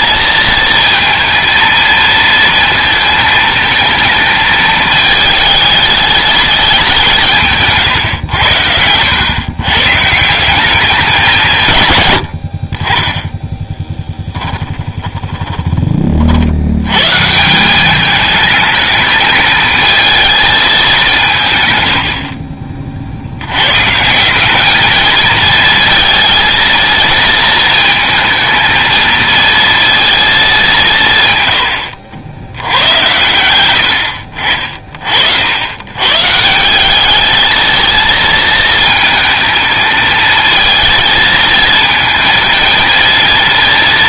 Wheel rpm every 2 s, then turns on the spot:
230, 230, 220, 210, 100, 180, 50, 10, 90, 210, 210, 50, 210, 220, 220, 200, 90, 50, 190, 220, 220, 230.
14-16